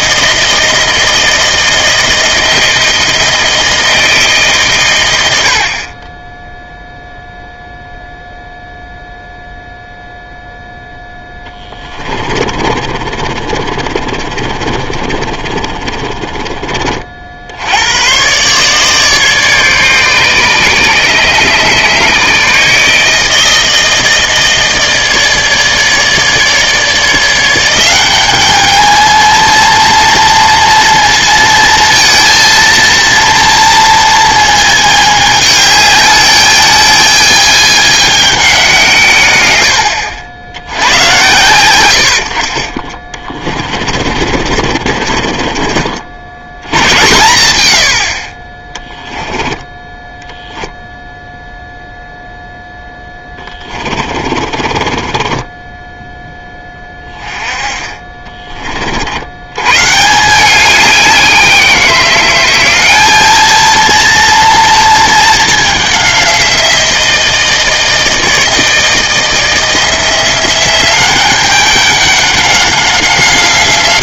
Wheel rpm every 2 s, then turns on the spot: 160, 160, 140, 10, 0, 0, 30, 30, 30, 130, 140, 150, 160, 150, 210, 230, 230, 220, 210, 180, 60, 60, 50, 90, 30, 0, 0, 30, 10, 40, 190, 190, 230, 180, 160, 180, 190.
12-16 44-46 54-56